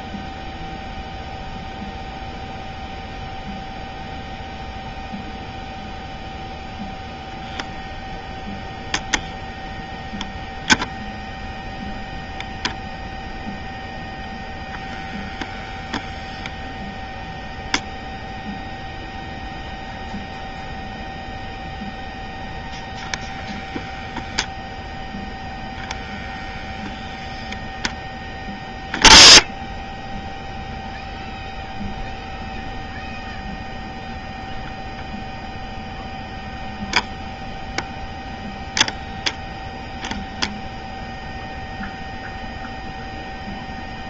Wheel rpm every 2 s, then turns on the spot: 0, 0, 0, 0, 0, 0, 0, 0, 0, 0, 0, 0, 0, 0, 10, 0, 0, 0, 0, 0, 0, 0.
none